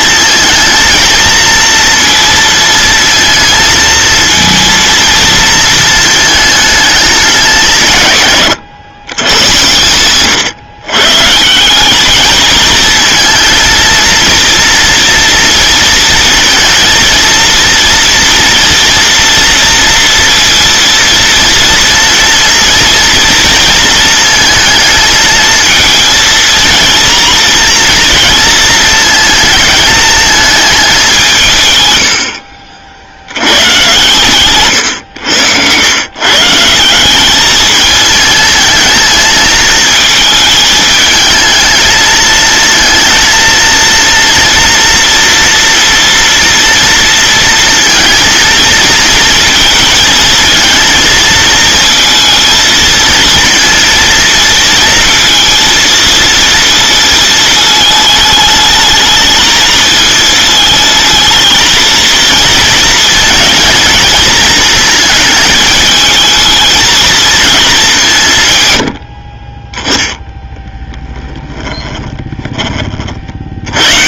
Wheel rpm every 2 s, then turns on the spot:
220, 230, 230, 210, 110, 130, 220, 230, 230, 230, 230, 230, 230, 230, 220, 210, 70, 120, 150, 220, 220, 230, 240, 240, 230, 230, 220, 230, 230, 220, 220, 220, 220, 220, 110, 20, 40.
70-72